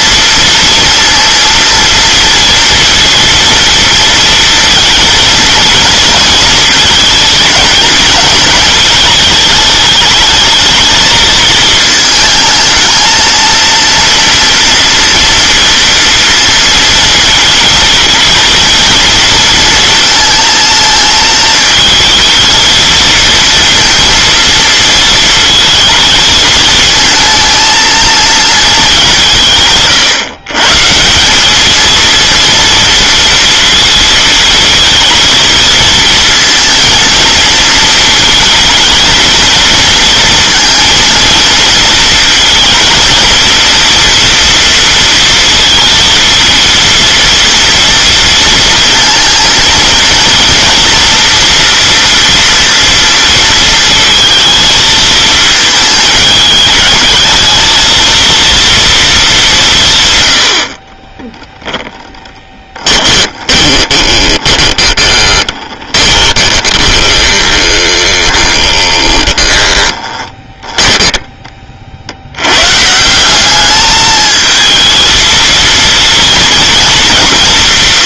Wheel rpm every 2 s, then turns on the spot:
230, 230, 230, 220, 220, 220, 220, 230, 230, 230, 220, 220, 230, 220, 210, 140, 230, 220, 230, 220, 230, 230, 230, 230, 230, 230, 230, 220, 210, 230, 70, 20, 20, 20, 20, 10, 120, 220, 230.
62-72